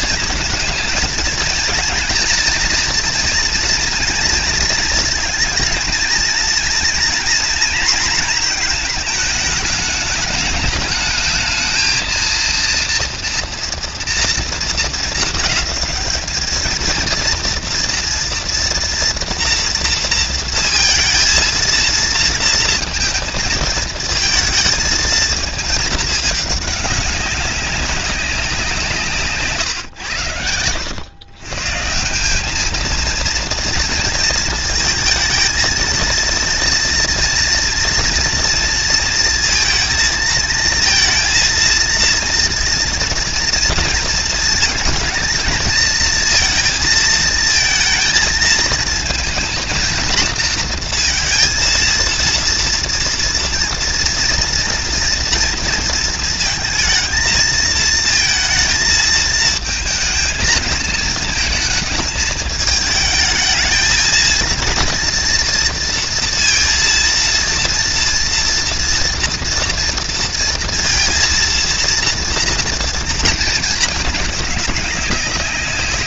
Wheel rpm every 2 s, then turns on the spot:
230, 230, 230, 230, 210, 220, 230, 220, 230, 230, 230, 220, 210, 200, 110, 160, 230, 230, 230, 220, 230, 230, 220, 220, 230, 230, 230, 230, 230, 220, 220, 220, 230, 230, 230, 230, 220, 200.
none